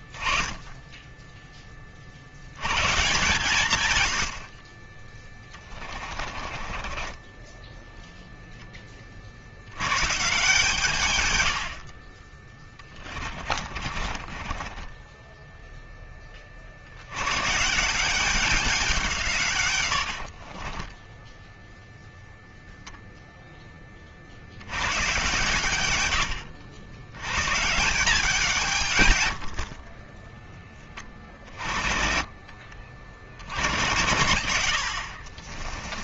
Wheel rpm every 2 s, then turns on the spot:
0, 20, 120, 20, 10, 120, 50, 30, 20, 180, 70, 0, 90, 100, 140, 30, 70, 60.
6-10 14-16 20-22 34-36